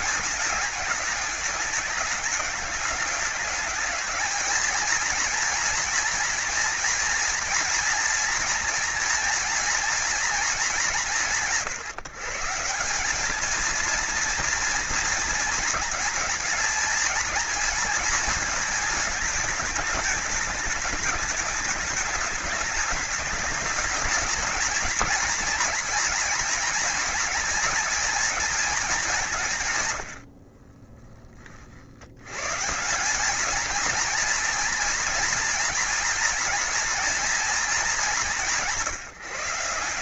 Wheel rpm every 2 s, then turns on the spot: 210, 210, 230, 230, 230, 200, 180, 230, 220, 220, 210, 210, 220, 230, 200, 10, 180, 230, 230, 170.
none